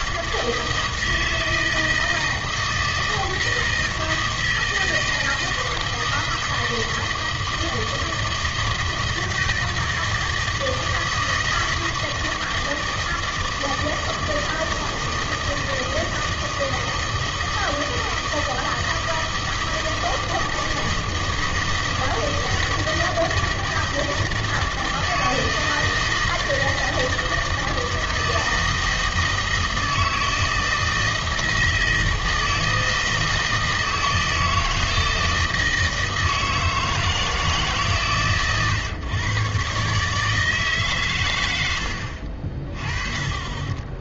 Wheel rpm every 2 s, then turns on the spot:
160, 160, 160, 160, 160, 160, 160, 160, 160, 160, 160, 160, 160, 160, 160, 160, 160, 160, 160, 130, 140, 40.
none